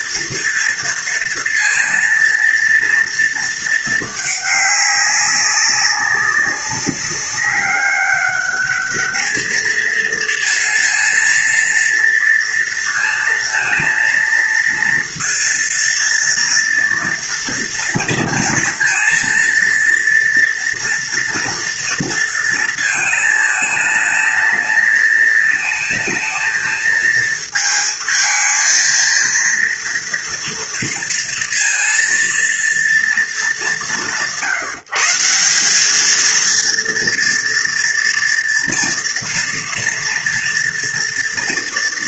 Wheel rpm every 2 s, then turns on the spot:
230, 230, 210, 200, 200, 230, 230, 230, 230, 230, 230, 230, 220, 220, 220, 230, 230, 160, 230, 240, 230.
none